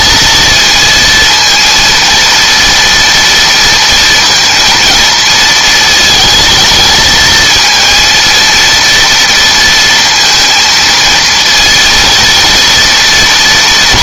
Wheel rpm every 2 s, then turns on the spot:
230, 230, 230, 220, 230, 230, 220.
none